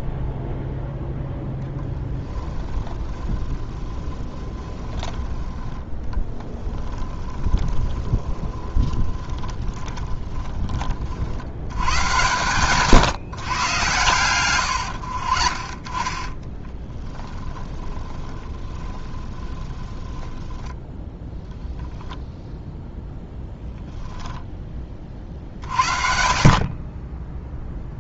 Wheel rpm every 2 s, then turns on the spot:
0, 20, 20, 20, 20, 20, 140, 100, 10, 20, 10, 0, 20, 40.
2-10 14-20